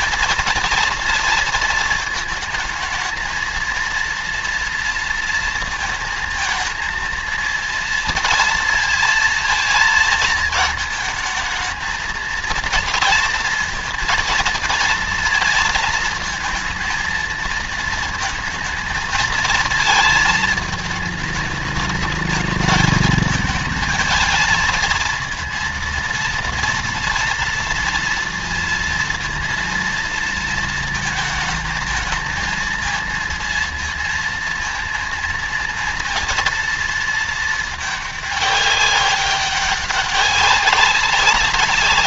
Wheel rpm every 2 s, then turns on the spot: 230, 220, 230, 220, 220, 220, 230, 230, 220, 220, 220, 210, 220, 230, 230, 220, 220, 230, 230, 200, 200.
none